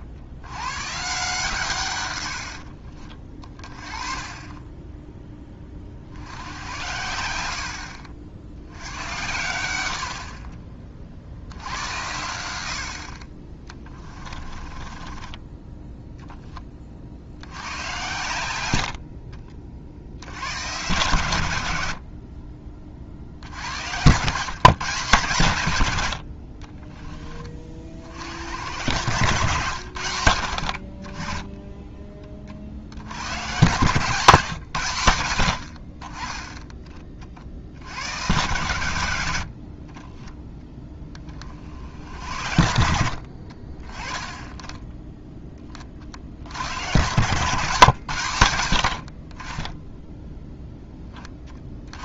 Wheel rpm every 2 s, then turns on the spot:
100, 70, 30, 80, 80, 30, 70, 30, 20, 90, 110, 40, 150, 40, 90, 60, 40, 140, 10, 110, 10, 70, 10, 100, 100, 10.
2-4 14-16 26-28